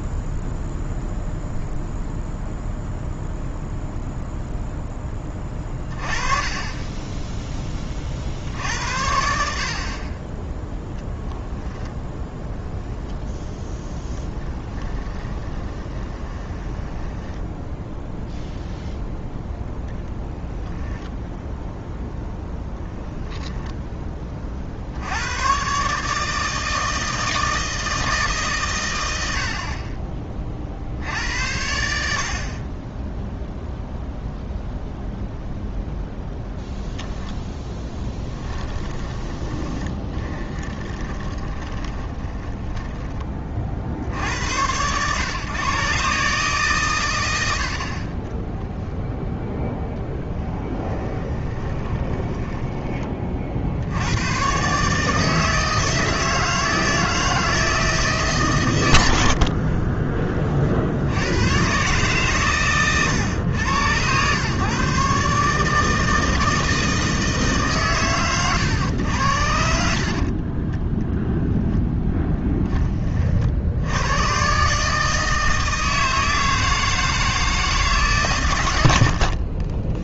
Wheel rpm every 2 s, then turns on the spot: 0, 0, 10, 10, 70, 0, 10, 10, 10, 10, 10, 10, 60, 160, 110, 60, 40, 0, 0, 10, 20, 10, 100, 120, 0, 10, 20, 140, 160, 120, 60, 120, 140, 160, 110, 10, 20, 150, 160, 70.
14-18 22-24 38-44 50-54